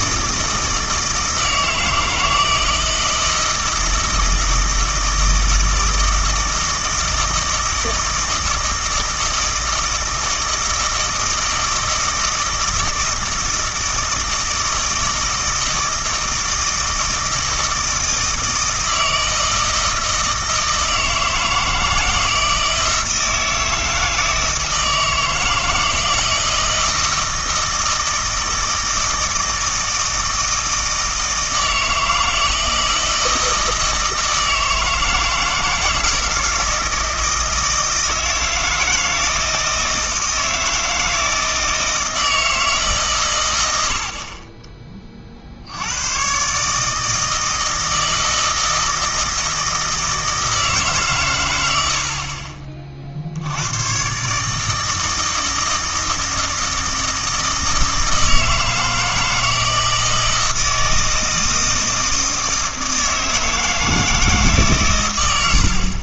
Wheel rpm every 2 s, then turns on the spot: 160, 160, 160, 160, 160, 160, 160, 160, 160, 160, 160, 160, 160, 160, 160, 160, 160, 160, 160, 160, 160, 160, 30, 140, 160, 160, 40, 160, 160, 160, 160, 160, 140.
none